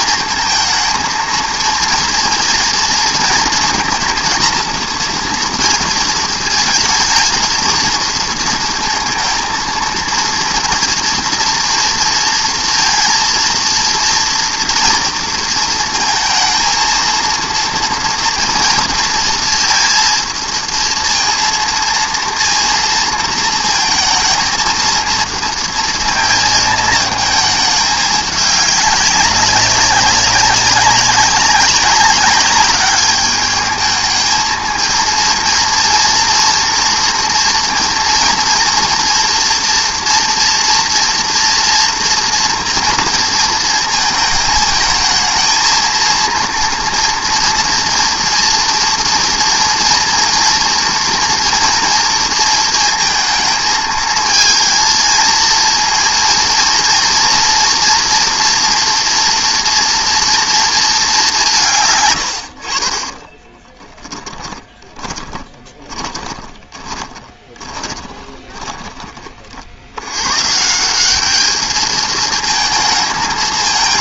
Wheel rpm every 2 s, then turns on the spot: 230, 230, 230, 220, 230, 230, 230, 240, 230, 230, 230, 230, 220, 220, 200, 190, 200, 220, 230, 230, 240, 240, 220, 230, 230, 230, 230, 230, 230, 230, 230, 60, 20, 20, 20, 150, 220.
64-70